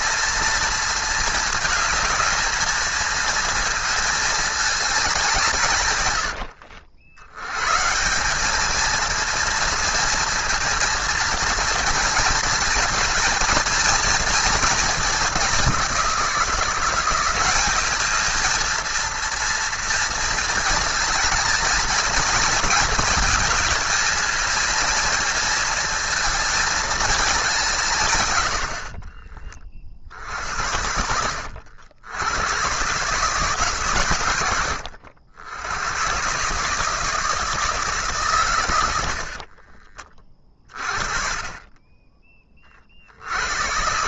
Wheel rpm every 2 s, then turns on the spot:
230, 220, 210, 80, 220, 230, 220, 210, 180, 220, 220, 220, 230, 220, 60, 80, 120, 100, 150, 80, 40, 50.
none